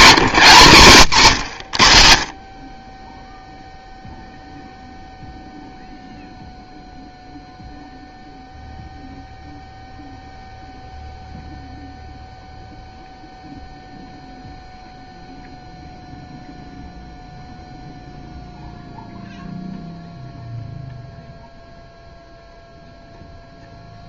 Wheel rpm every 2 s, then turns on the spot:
150, 40, 0, 0, 0, 0, 0, 0, 0, 0, 0, 0.
0-2